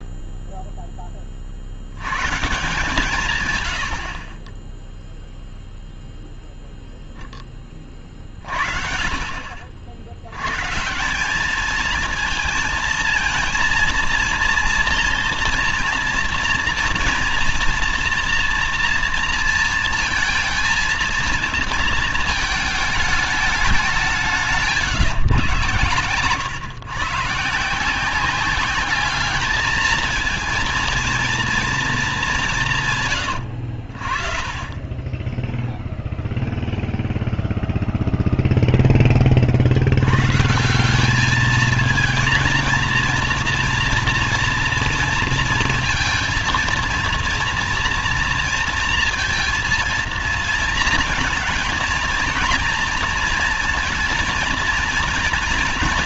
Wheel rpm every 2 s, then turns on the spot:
0, 150, 20, 0, 50, 130, 230, 230, 230, 230, 230, 220, 160, 120, 190, 230, 180, 40, 0, 0, 150, 230, 230, 230, 230, 230, 230, 230.
4-6 24-26